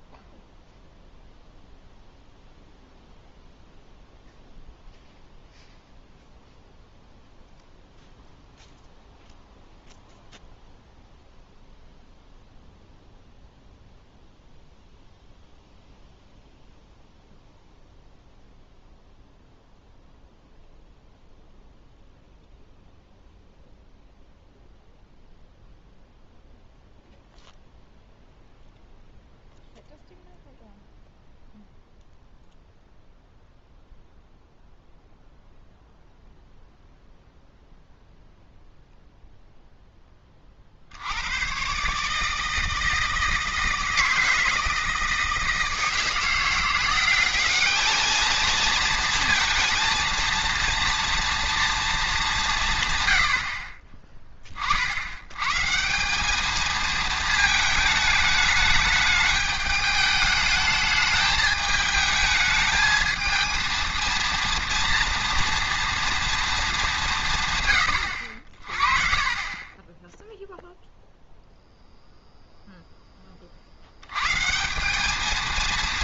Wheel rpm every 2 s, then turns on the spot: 0, 0, 0, 0, 0, 0, 0, 0, 0, 0, 0, 0, 0, 0, 0, 0, 0, 0, 0, 0, 50, 160, 160, 180, 230, 230, 150, 50, 220, 210, 210, 220, 230, 210, 50, 0, 0, 160.
none